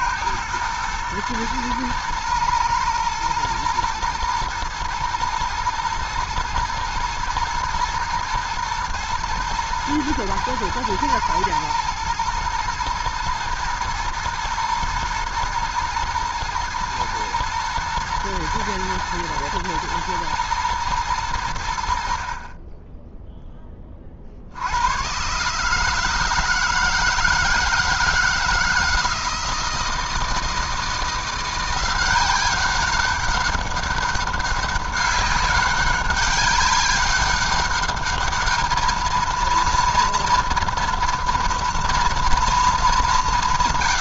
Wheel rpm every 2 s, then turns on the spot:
110, 120, 110, 110, 110, 110, 120, 110, 110, 110, 120, 30, 80, 160, 160, 160, 190, 200, 200, 220, 230, 220.
none